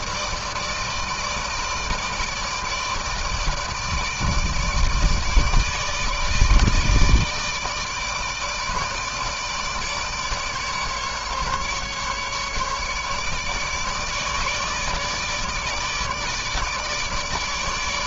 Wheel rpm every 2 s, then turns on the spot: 160, 160, 160, 160, 150, 150, 150, 150, 150.
none